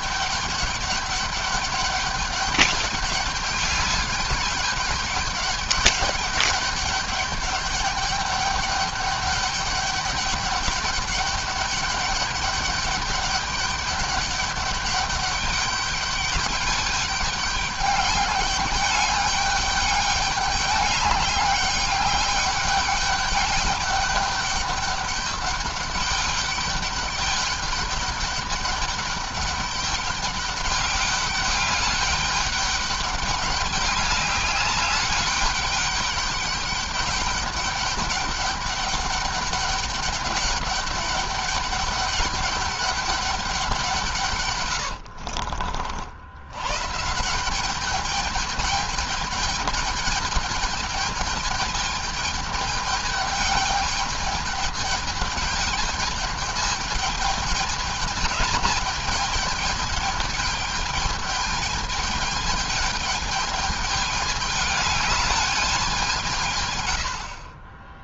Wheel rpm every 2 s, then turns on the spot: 200, 200, 200, 200, 210, 210, 200, 200, 200, 200, 200, 200, 200, 210, 200, 200, 200, 200, 200, 200, 200, 210, 70, 160, 220, 210, 210, 210, 210, 210, 210, 210, 210, 90.
44-46